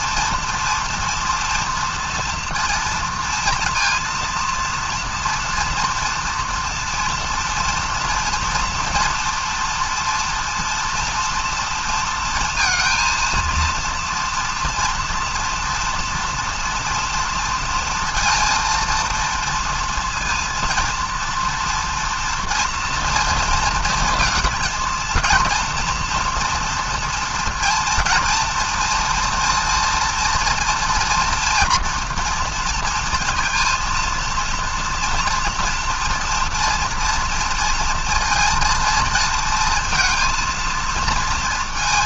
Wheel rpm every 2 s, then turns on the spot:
230, 230, 230, 230, 240, 230, 230, 240, 230, 230, 230, 230, 230, 230, 230, 230, 230, 230, 230, 230, 230.
none